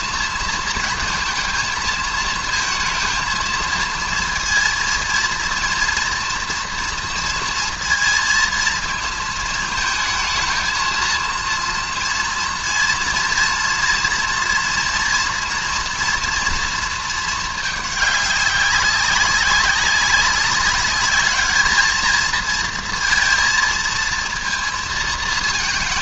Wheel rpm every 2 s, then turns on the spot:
230, 230, 230, 230, 230, 220, 230, 230, 230, 200, 200, 230, 230.
none